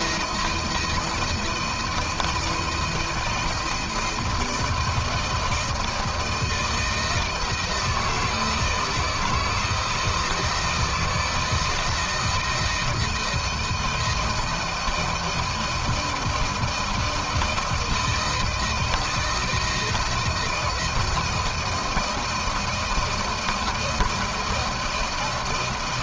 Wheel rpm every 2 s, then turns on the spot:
160, 170, 160, 160, 160, 160, 170, 160, 160, 160, 170, 160, 170.
none